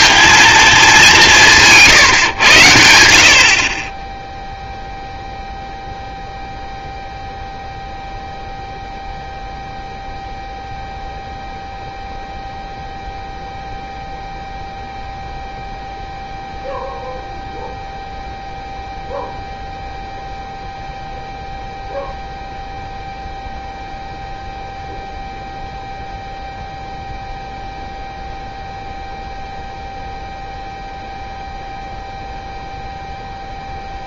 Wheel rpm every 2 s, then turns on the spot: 220, 110, 0, 0, 0, 0, 0, 0, 0, 0, 0, 0, 0, 0, 0, 0, 0.
none